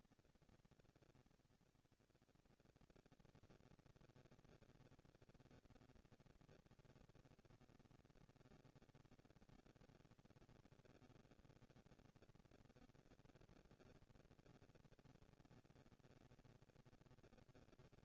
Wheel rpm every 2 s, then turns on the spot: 220, 230, 220, 230, 230, 230, 230, 230, 220.
none